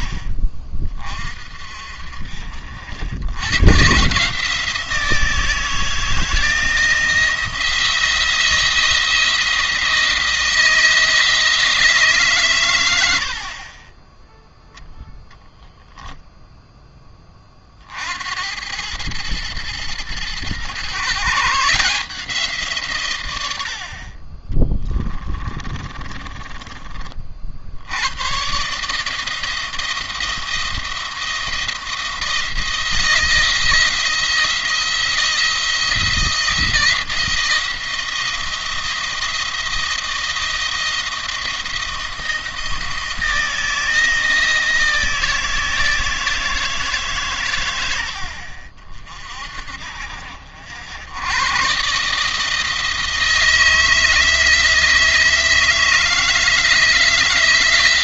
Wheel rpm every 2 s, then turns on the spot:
30, 70, 160, 170, 170, 160, 110, 10, 10, 100, 130, 150, 30, 30, 140, 170, 170, 170, 170, 170, 170, 170, 170, 160, 50, 80, 160, 160, 160.
24-26